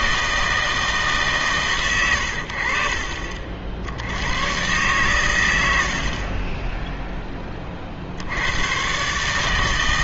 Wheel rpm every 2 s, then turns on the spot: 160, 60, 110, 20, 100.
none